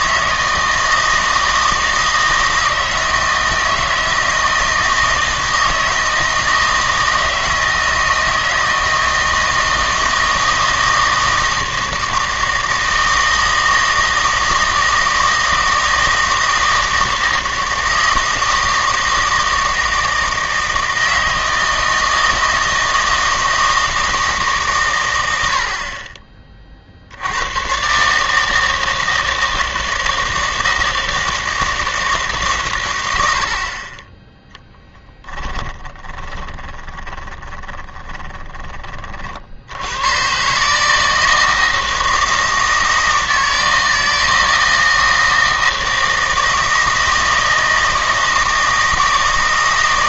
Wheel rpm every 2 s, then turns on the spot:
160, 160, 160, 160, 160, 160, 160, 160, 160, 160, 160, 160, 140, 40, 160, 160, 140, 10, 20, 20, 140, 160, 160, 160, 160.
36-38